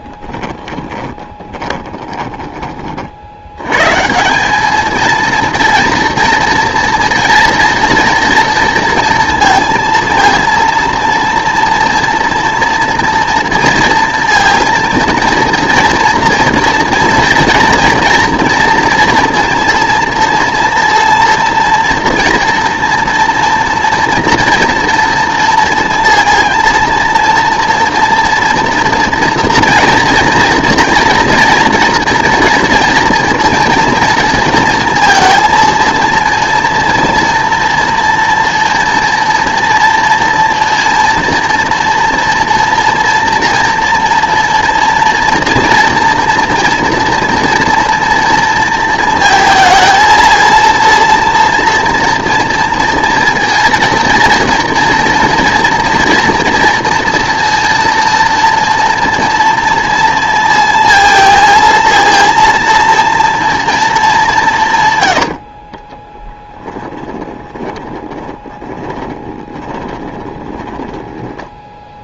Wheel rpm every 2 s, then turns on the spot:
20, 30, 210, 230, 230, 230, 230, 230, 230, 230, 230, 230, 230, 230, 230, 230, 240, 230, 230, 240, 230, 230, 230, 230, 230, 230, 230, 230, 230, 240, 230, 230, 160, 10, 20, 20.
0-2 66-72